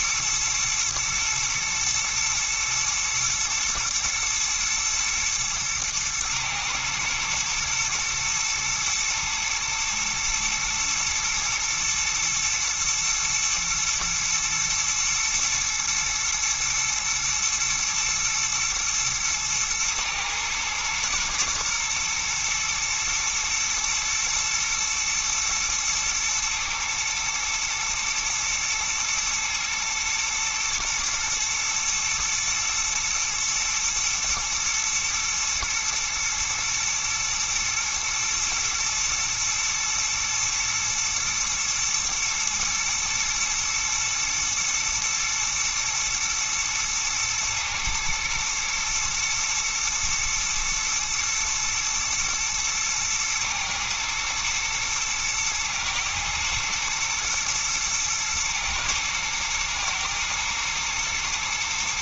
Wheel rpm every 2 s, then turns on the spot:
110, 120, 120, 110, 120, 110, 110, 110, 120, 110, 110, 120, 120, 120, 110, 120, 120, 110, 120, 110, 120, 110, 110, 110, 110, 120, 120, 110, 110, 110, 120.
none